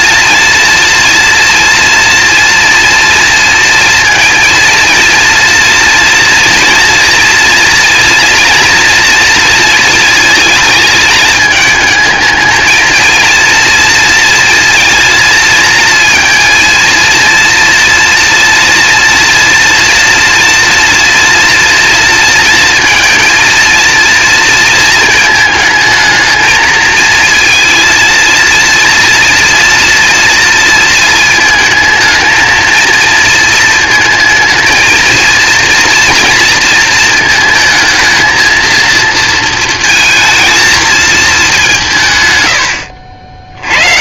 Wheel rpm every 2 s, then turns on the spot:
230, 230, 230, 230, 240, 220, 220, 230, 230, 230, 240, 230, 230, 220, 230, 230, 220, 220, 230, 230, 220, 110.
none